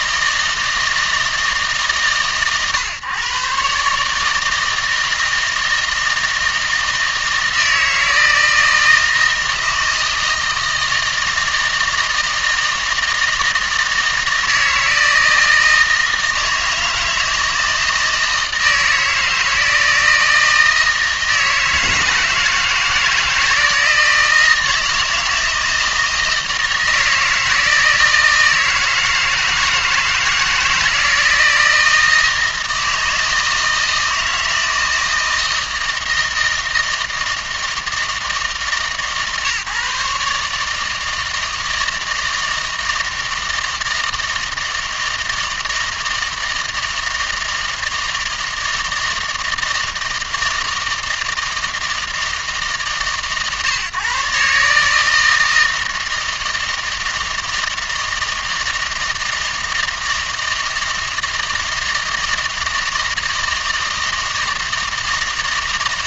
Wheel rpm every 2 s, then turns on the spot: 160, 120, 160, 160, 160, 160, 160, 160, 160, 160, 160, 160, 160, 160, 160, 160, 160, 160, 160, 150, 150, 160, 160, 160, 160, 160, 150, 150, 160, 160, 160, 160, 160.
none